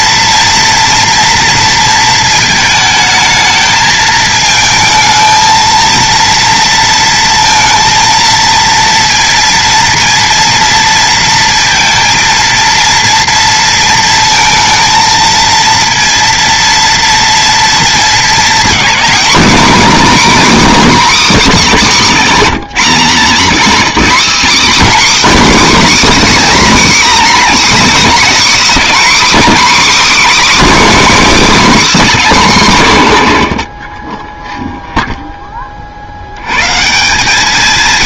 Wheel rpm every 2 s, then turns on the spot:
230, 220, 220, 230, 230, 230, 230, 230, 230, 250, 290, 240, 310, 280, 290, 310, 140, 0, 170.
none